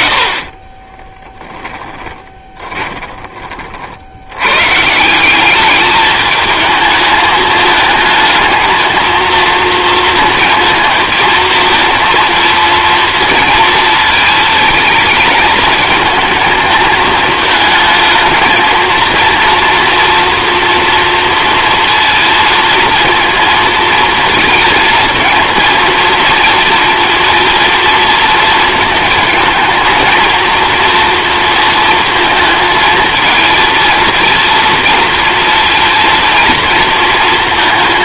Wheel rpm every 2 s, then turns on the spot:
20, 20, 140, 220, 230, 230, 230, 220, 220, 230, 230, 230, 230, 230, 220, 230, 220, 230, 230.
0-4